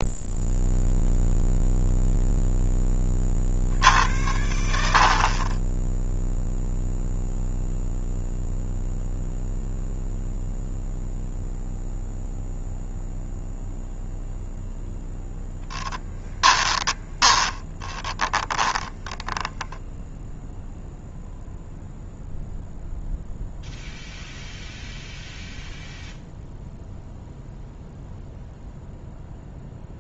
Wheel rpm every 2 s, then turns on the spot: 0, 20, 70, 0, 0, 0, 0, 0, 10, 20, 0, 0, 0, 0, 0.
18-20